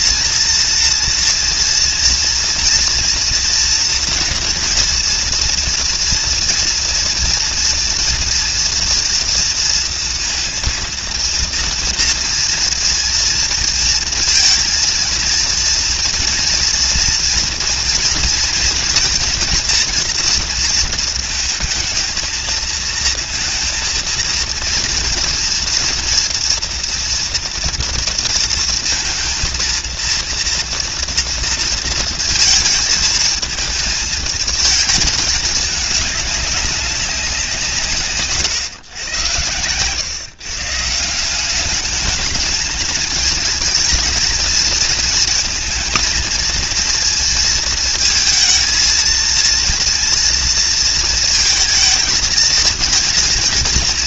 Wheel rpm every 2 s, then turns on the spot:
230, 240, 230, 230, 230, 230, 230, 230, 230, 230, 230, 220, 230, 230, 230, 230, 220, 220, 200, 120, 150, 220, 220, 230, 230, 230, 220.
none